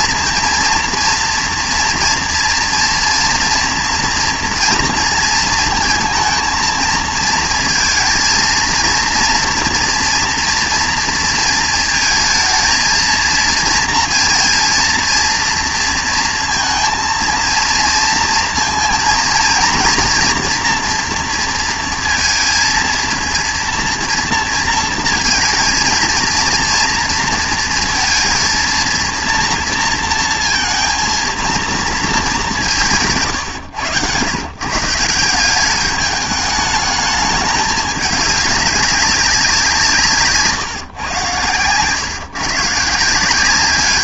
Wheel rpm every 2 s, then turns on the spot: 230, 230, 230, 220, 230, 230, 220, 230, 230, 230, 230, 230, 230, 230, 230, 230, 190, 140, 210, 200, 130, 130.
none